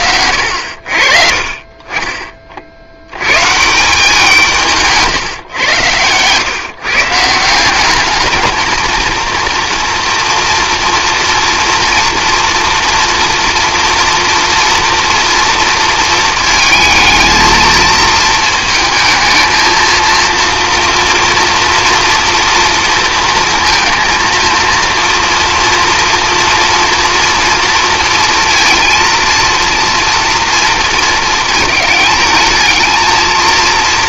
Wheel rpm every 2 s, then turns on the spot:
70, 40, 160, 140, 220, 230, 240, 240, 220, 220, 240, 230, 230, 230, 230, 230, 220.
none